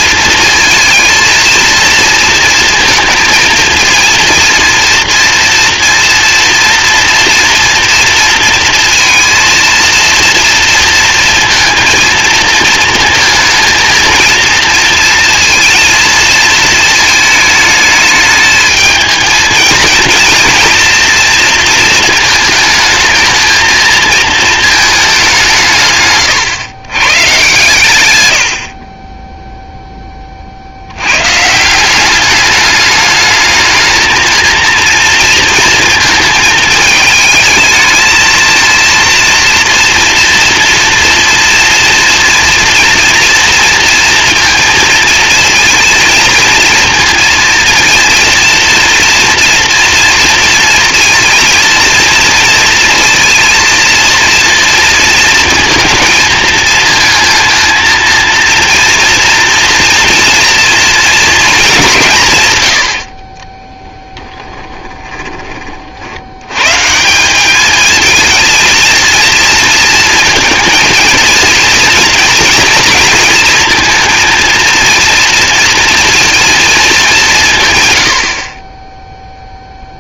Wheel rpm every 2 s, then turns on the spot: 220, 230, 230, 230, 230, 230, 230, 230, 220, 220, 230, 220, 220, 120, 60, 70, 210, 230, 220, 230, 230, 230, 220, 230, 230, 230, 230, 230, 230, 230, 230, 110, 20, 140, 230, 220, 230, 230, 220, 20.
64-66